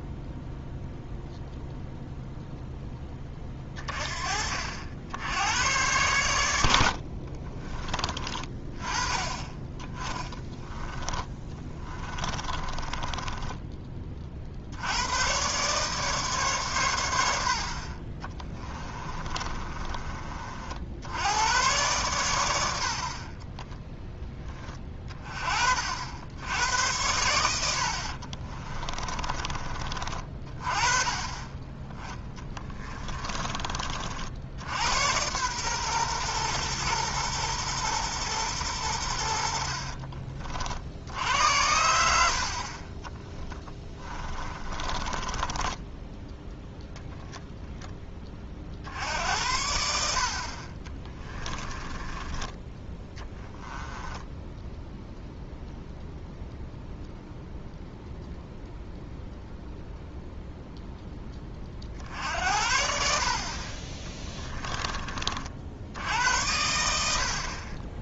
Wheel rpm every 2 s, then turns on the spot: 0, 10, 70, 80, 20, 10, 20, 70, 120, 20, 60, 80, 20, 90, 30, 30, 30, 80, 120, 100, 60, 60, 20, 10, 50, 40, 10, 0, 0, 0, 0, 60, 30, 80.
10-14 18-20 28-30 32-34 42-48